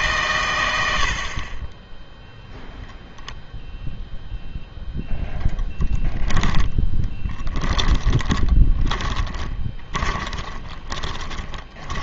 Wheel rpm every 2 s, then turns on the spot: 110, 0, 0, 10, 30, 20.
6-12